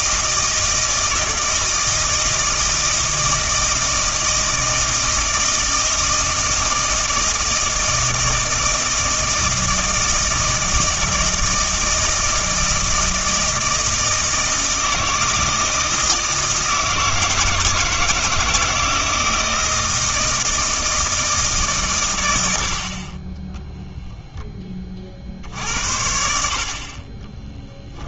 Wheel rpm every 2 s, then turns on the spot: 160, 160, 160, 160, 160, 160, 160, 160, 160, 160, 160, 70, 20, 50.
none